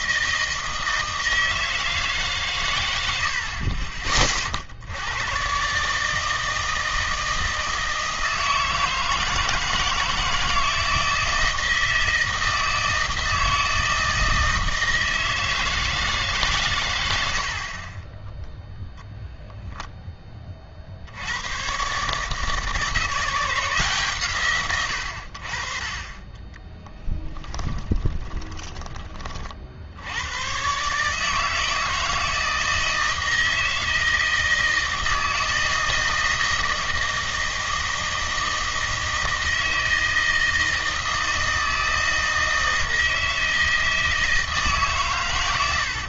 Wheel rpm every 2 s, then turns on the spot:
160, 120, 50, 160, 160, 160, 160, 160, 120, 0, 40, 150, 130, 20, 20, 130, 160, 160, 160, 160, 160, 160, 150.
26-28